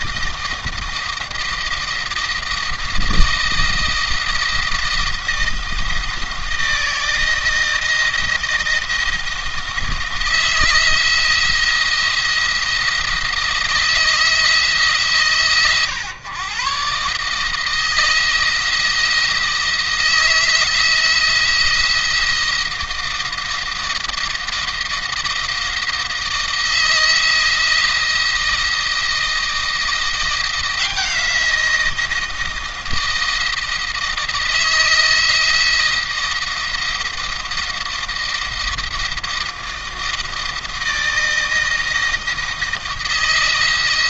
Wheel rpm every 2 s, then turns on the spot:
170, 160, 160, 160, 170, 170, 170, 160, 120, 170, 160, 170, 170, 170, 160, 170, 160, 160, 170, 170, 160, 170.
none